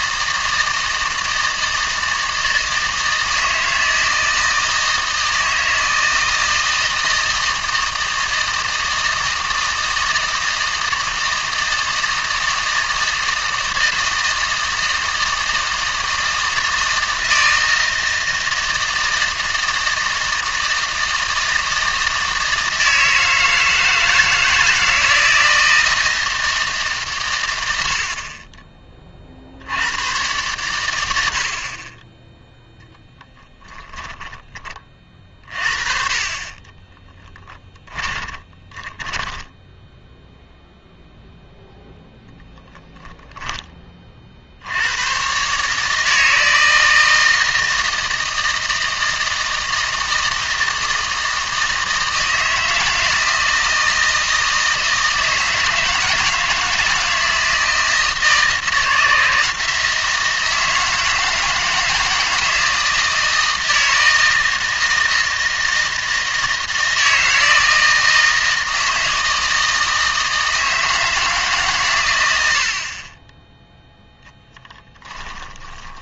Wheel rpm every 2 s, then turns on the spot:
160, 160, 160, 160, 160, 160, 160, 160, 160, 160, 160, 160, 160, 150, 20, 100, 10, 30, 20, 10, 0, 0, 90, 160, 160, 160, 170, 160, 160, 160, 160, 160, 160, 160, 160, 160, 40, 10.
36-40 74-76